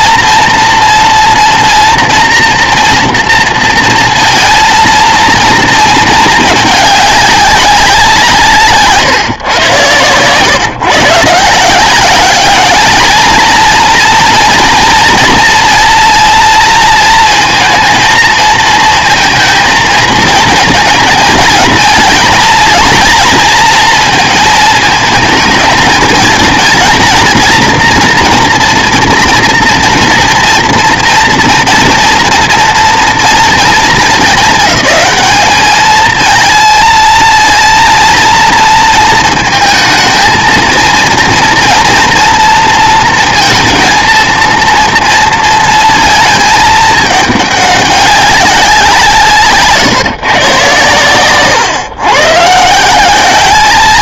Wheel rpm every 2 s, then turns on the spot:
230, 240, 230, 210, 160, 130, 210, 240, 230, 220, 230, 230, 220, 230, 230, 230, 230, 200, 220, 230, 230, 230, 230, 220, 190, 120, 150.
none